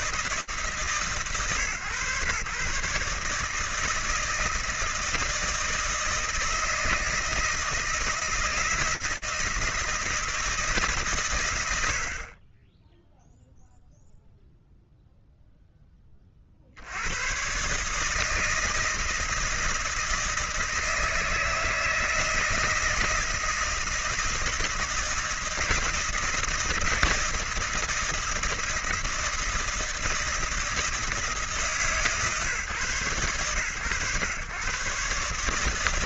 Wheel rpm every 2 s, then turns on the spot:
150, 140, 160, 160, 160, 130, 10, 0, 110, 160, 160, 160, 160, 160, 160, 140, 120, 150.
none